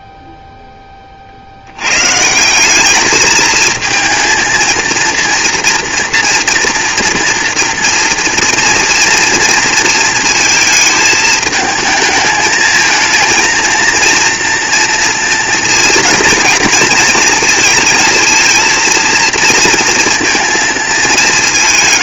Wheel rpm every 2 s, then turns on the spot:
10, 190, 230, 230, 240, 230, 220, 230, 230, 230, 220.
none